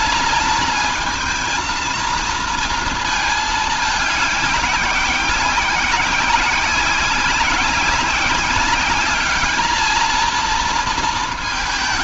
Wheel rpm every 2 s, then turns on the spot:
230, 230, 200, 190, 200, 230.
none